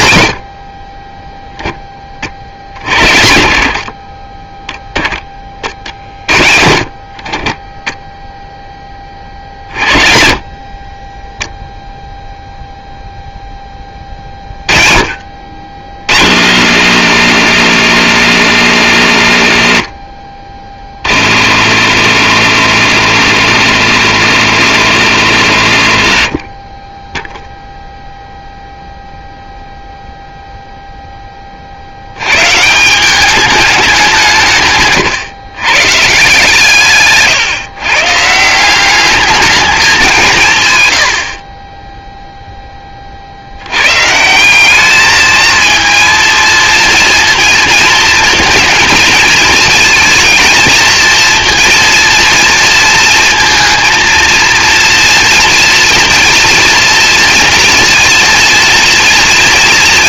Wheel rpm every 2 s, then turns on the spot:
40, 70, 10, 40, 10, 20, 0, 30, 80, 70, 30, 80, 80, 10, 0, 0, 170, 140, 140, 200, 100, 30, 210, 230, 220, 220, 230, 230, 230, 230.
40-42